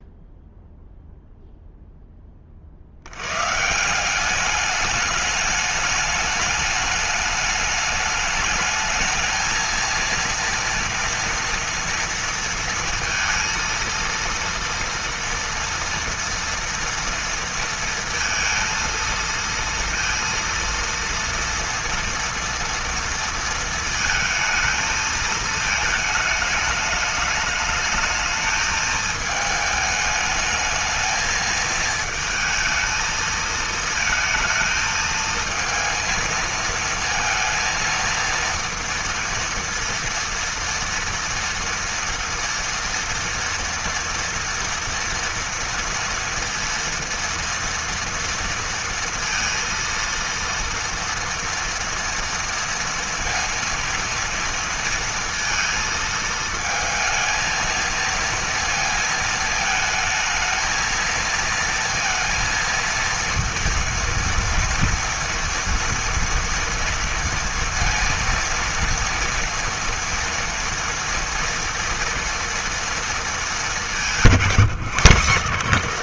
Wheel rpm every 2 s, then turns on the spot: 0, 100, 210, 210, 220, 230, 230, 230, 230, 230, 230, 230, 220, 210, 220, 220, 220, 220, 230, 230, 230, 230, 230, 230, 230, 230, 230, 230, 230, 230, 230, 230, 230, 230, 230, 230, 230, 150.
none